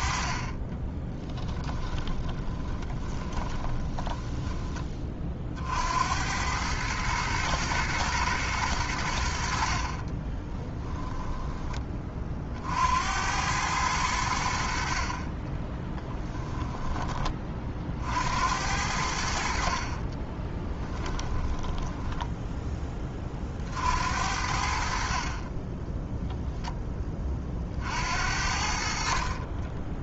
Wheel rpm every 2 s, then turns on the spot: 30, 20, 30, 110, 90, 10, 80, 40, 20, 80, 10, 20, 50, 20, 40.
0-4 10-12 20-22